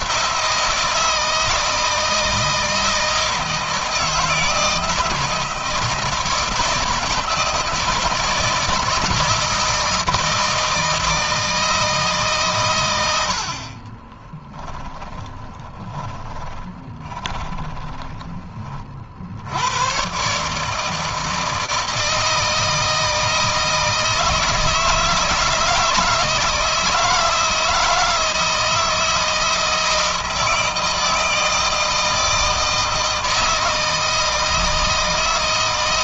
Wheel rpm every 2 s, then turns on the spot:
170, 160, 160, 160, 160, 160, 90, 10, 20, 40, 150, 160, 160, 160, 160, 160, 160, 160.
14-18